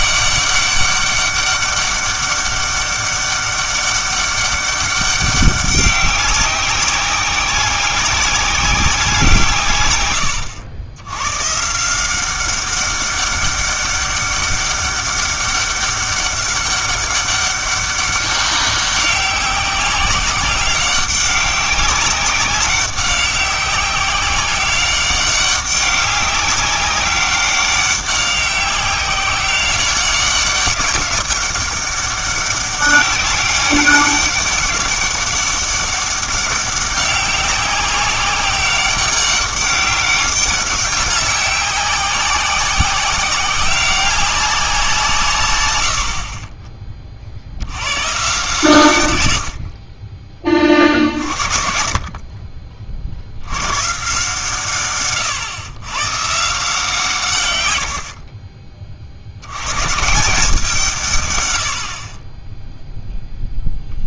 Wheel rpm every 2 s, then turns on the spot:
200, 200, 200, 190, 190, 100, 190, 200, 200, 190, 190, 200, 190, 200, 190, 200, 200, 200, 200, 190, 200, 190, 180, 20, 140, 50, 50, 140, 150, 30, 170, 0.
none